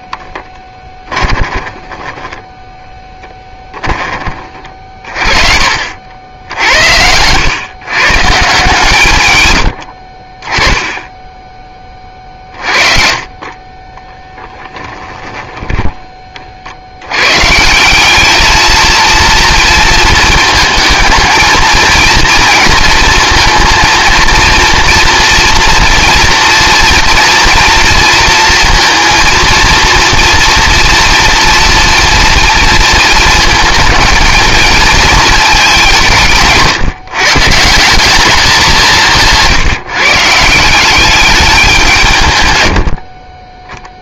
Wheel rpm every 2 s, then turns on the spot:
20, 10, 40, 80, 140, 10, 40, 20, 90, 230, 220, 230, 230, 240, 230, 230, 230, 230, 160, 190, 190, 60.
0-4 12-16 42-44